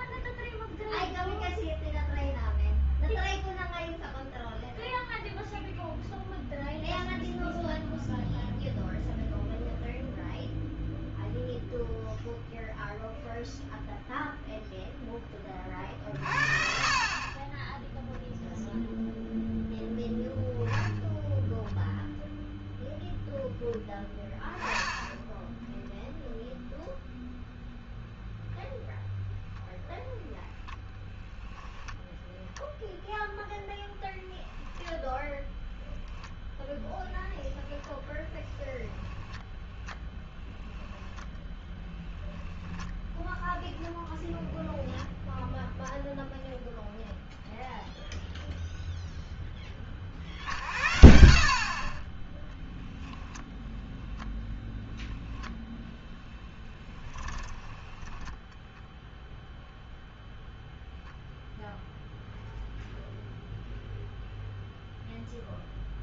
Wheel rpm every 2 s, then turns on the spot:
0, 0, 0, 0, 0, 0, 0, 0, 50, 0, 0, 0, 10, 0, 0, 0, 0, 10, 0, 0, 10, 10, 0, 0, 0, 70, 10, 10, 10, 10, 0, 0, 0.
42-44 56-60